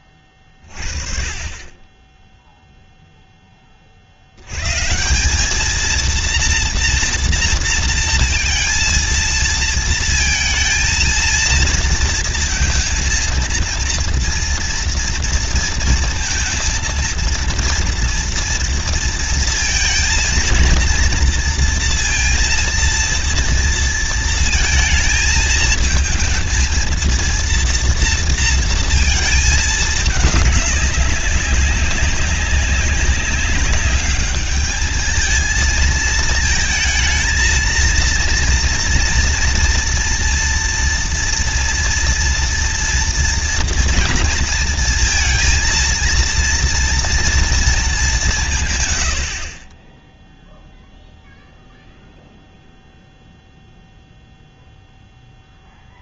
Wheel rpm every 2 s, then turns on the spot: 20, 20, 90, 230, 230, 220, 230, 230, 230, 230, 230, 230, 230, 220, 230, 210, 190, 210, 220, 230, 240, 240, 230, 230, 180, 0, 0, 0.
none